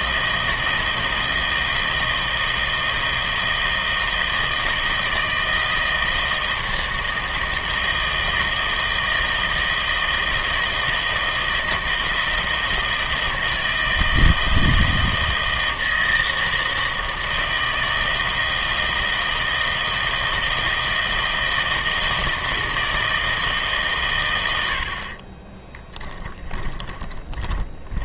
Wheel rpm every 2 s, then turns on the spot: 160, 160, 160, 160, 160, 160, 160, 160, 160, 160, 160, 160, 80, 20.
26-28